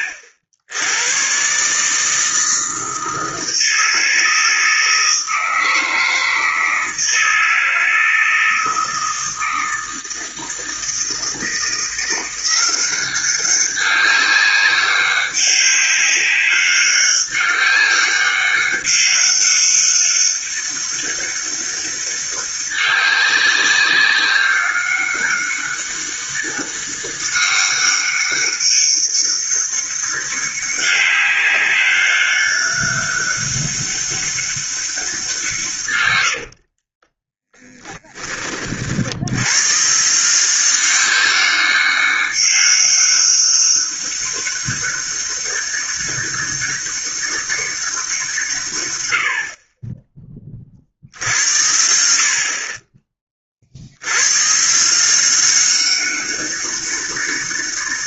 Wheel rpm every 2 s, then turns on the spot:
90, 160, 160, 160, 160, 160, 180, 190, 200, 200, 200, 200, 200, 200, 200, 200, 200, 200, 70, 40, 180, 200, 200, 200, 140, 40, 40, 140, 200.
36-38